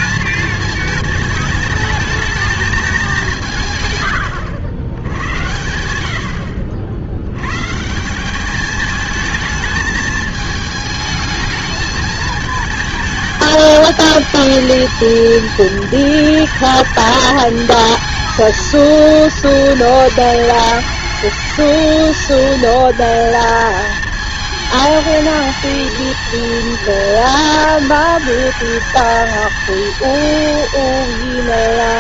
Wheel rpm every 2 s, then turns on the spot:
220, 210, 80, 60, 210, 220, 220, 220, 220, 230, 210, 230, 220, 230, 230, 230.
none